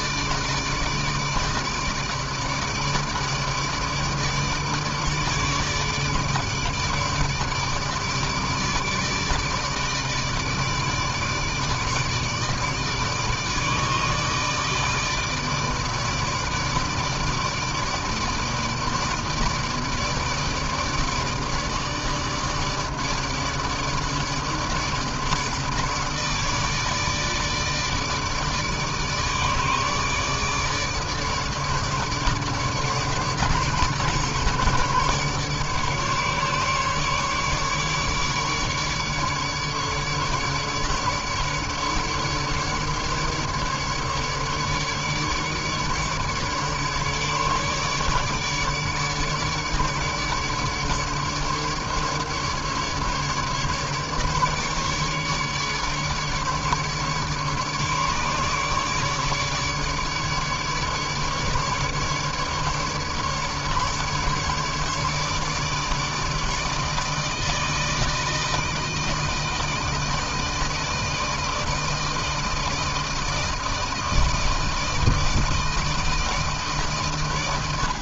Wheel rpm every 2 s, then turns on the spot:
150, 150, 150, 150, 160, 160, 160, 160, 150, 150, 150, 160, 160, 150, 150, 150, 150, 150, 150, 150, 150, 150, 150, 150, 150, 150, 150, 150, 150, 150, 150, 150, 150, 160, 160, 160, 160, 160, 130.
none